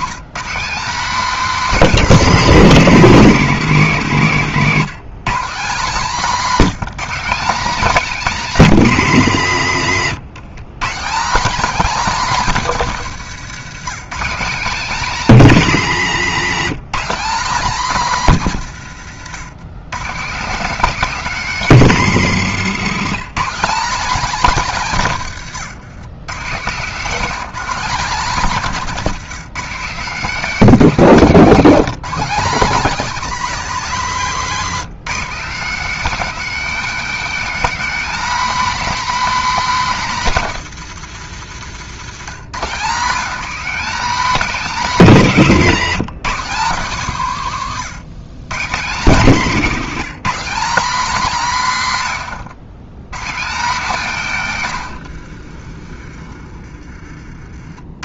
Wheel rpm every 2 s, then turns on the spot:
230, 200, 180, 220, 200, 160, 190, 210, 170, 120, 220, 180, 180, 170, 180, 210, 220, 190, 250, 280, 180, 170, 220, 170, 160, 220, 130, 110, 40.
28-30